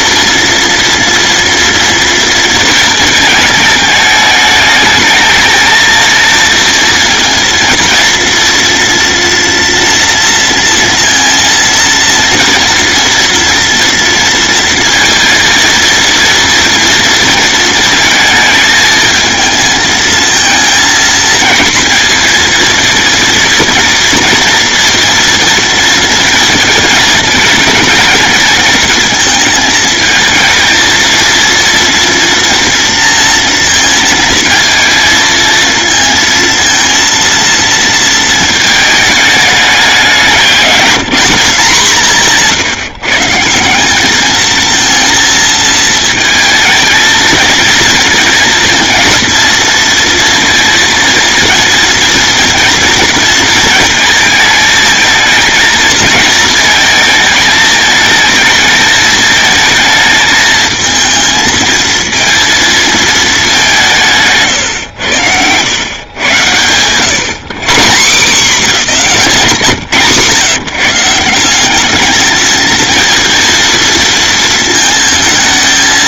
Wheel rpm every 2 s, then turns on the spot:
230, 220, 210, 230, 230, 230, 230, 230, 230, 220, 220, 230, 230, 220, 230, 230, 230, 220, 230, 220, 170, 150, 220, 220, 230, 230, 230, 220, 220, 220, 220, 230, 120, 110, 190, 140, 220, 220.
none